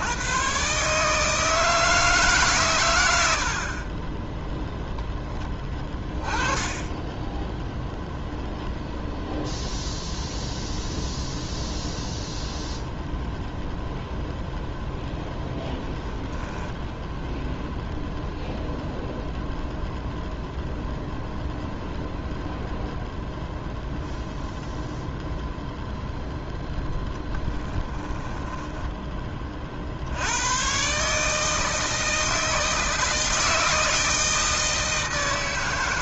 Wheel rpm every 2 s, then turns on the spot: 140, 100, 0, 10, 0, 0, 0, 0, 10, 0, 0, 0, 0, 10, 10, 120, 160, 160.
28-30